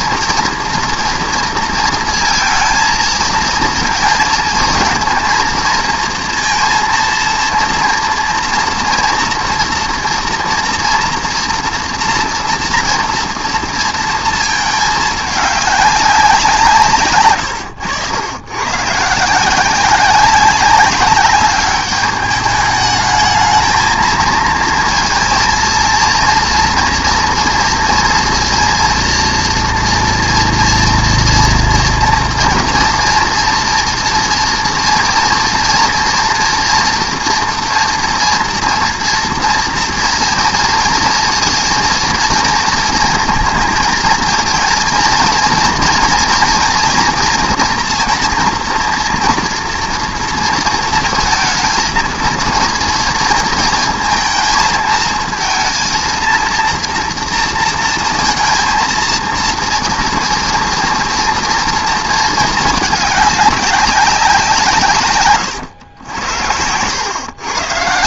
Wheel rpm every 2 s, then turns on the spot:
230, 230, 230, 230, 230, 230, 240, 220, 160, 120, 200, 210, 230, 230, 230, 230, 230, 230, 230, 230, 230, 230, 230, 240, 230, 230, 230, 220, 230, 230, 230, 210, 160, 90.
none